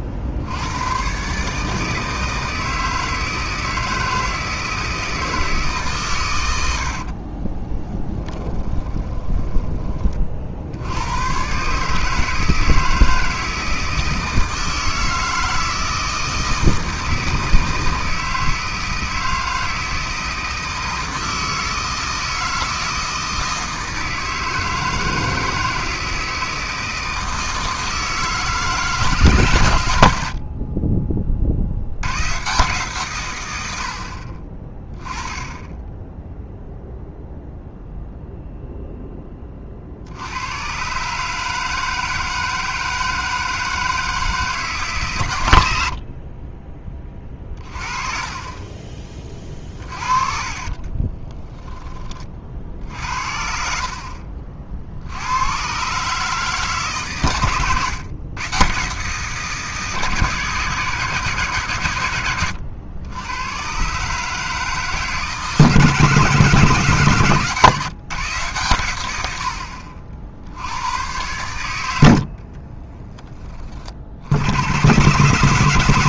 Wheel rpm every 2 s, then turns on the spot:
80, 160, 160, 90, 10, 60, 160, 160, 160, 160, 160, 160, 160, 160, 150, 50, 130, 30, 0, 0, 100, 160, 160, 30, 30, 30, 50, 60, 150, 130, 150, 90, 150, 150, 130, 80, 40, 90.
8-10 46-48 50-52 72-74